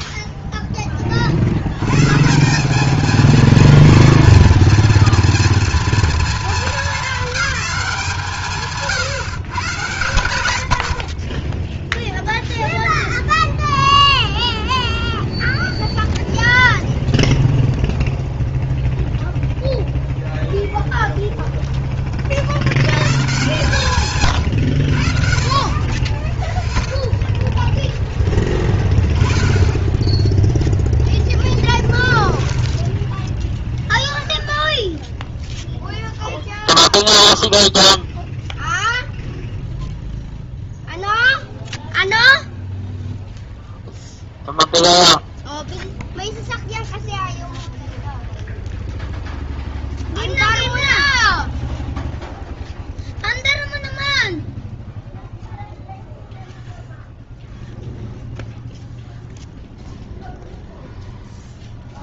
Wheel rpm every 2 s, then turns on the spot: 10, 200, 230, 210, 150, 80, 0, 0, 0, 0, 10, 60, 120, 20, 10, 0, 0, 0, 0, 0, 0, 0, 0, 0, 0, 0, 0, 0, 0, 0, 0.
20-22